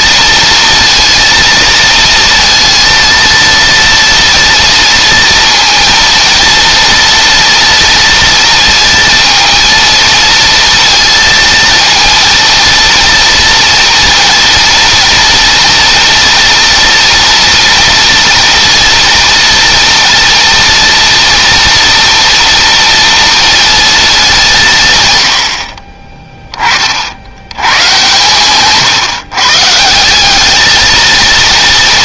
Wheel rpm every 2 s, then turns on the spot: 230, 230, 230, 230, 230, 230, 230, 230, 230, 230, 230, 230, 140, 40, 140, 220.
none